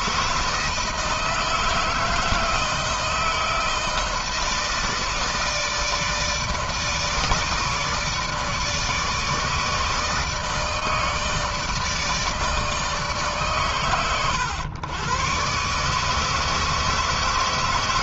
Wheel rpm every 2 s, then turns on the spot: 160, 160, 160, 160, 150, 160, 150, 100, 160.
none